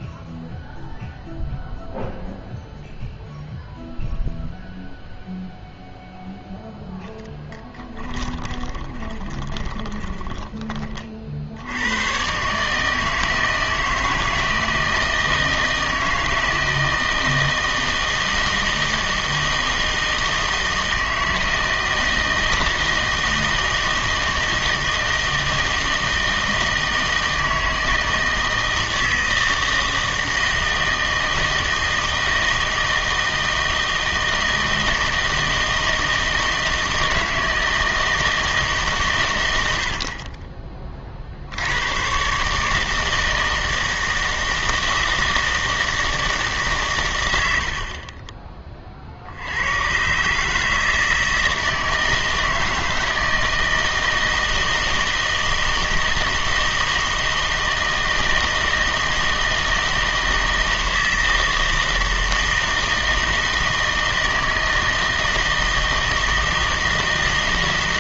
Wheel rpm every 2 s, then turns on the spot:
0, 0, 0, 0, 20, 20, 140, 160, 160, 160, 160, 160, 160, 160, 160, 160, 160, 160, 160, 150, 20, 150, 160, 140, 30, 150, 160, 160, 160, 160, 160, 160, 160, 160.
8-10